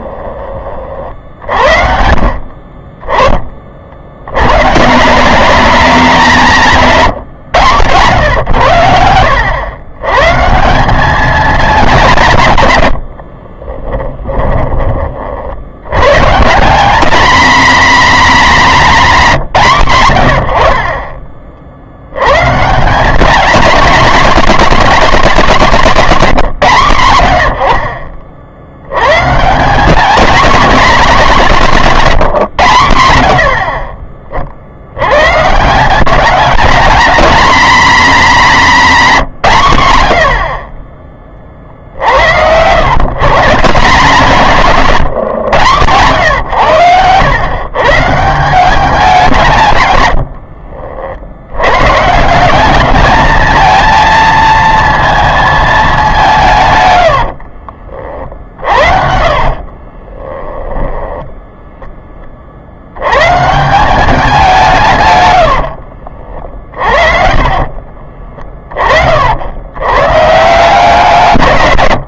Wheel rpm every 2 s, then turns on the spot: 40, 40, 120, 180, 100, 170, 130, 20, 180, 240, 60, 160, 230, 140, 80, 230, 130, 60, 210, 220, 40, 110, 180, 100, 190, 70, 190, 230, 130, 50, 10, 60, 170, 40, 30, 160.
12-16 44-46 50-52 58-62 66-68